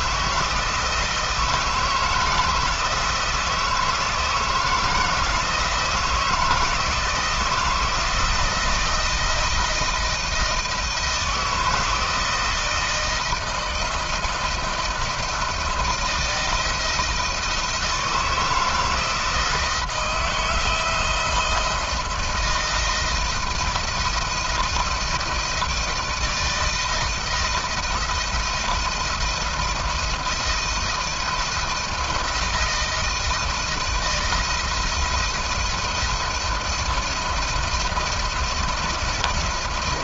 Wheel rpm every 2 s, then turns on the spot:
160, 160, 160, 160, 170, 160, 160, 170, 160, 160, 170, 160, 160, 160, 160, 160, 160, 170, 170, 170.
none